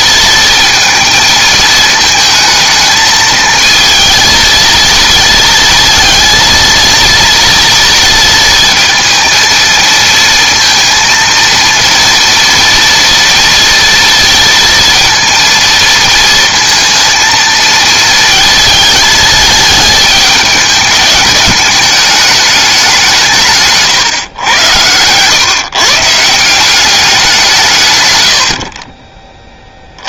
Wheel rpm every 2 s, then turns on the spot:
230, 220, 230, 230, 230, 230, 230, 230, 230, 220, 210, 200, 100, 180, 50.
28-30